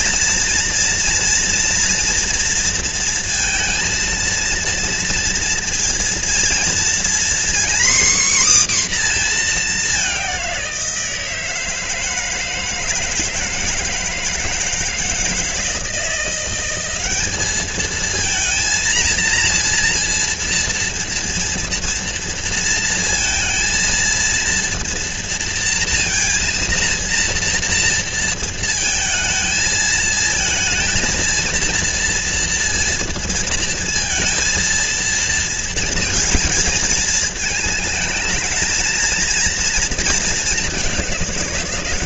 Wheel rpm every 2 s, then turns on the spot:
230, 230, 230, 240, 250, 170, 160, 160, 190, 230, 230, 230, 230, 230, 220, 230, 230, 230, 220, 230, 200.
none